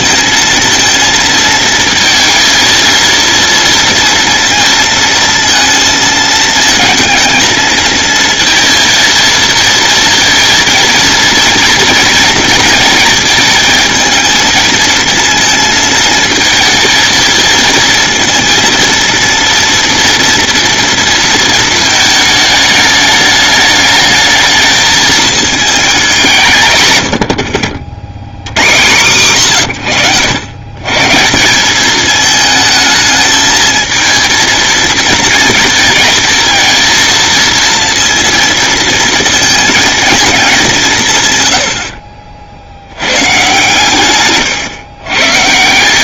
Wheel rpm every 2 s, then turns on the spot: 230, 230, 230, 220, 230, 230, 230, 220, 220, 230, 230, 220, 220, 120, 110, 140, 220, 230, 230, 230, 170, 80, 120.
none